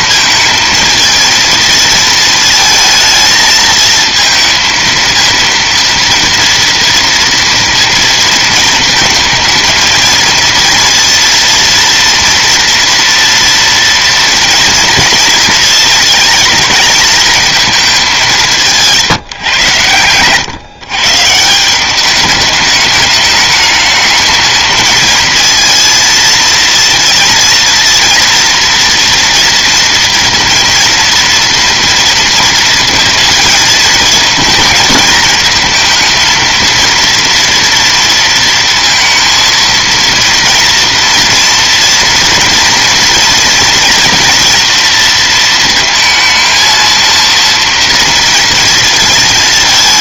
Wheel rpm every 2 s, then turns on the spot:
220, 220, 230, 230, 220, 230, 230, 230, 220, 180, 120, 210, 220, 230, 230, 230, 220, 220, 230, 230, 230, 230, 230, 230, 230.
none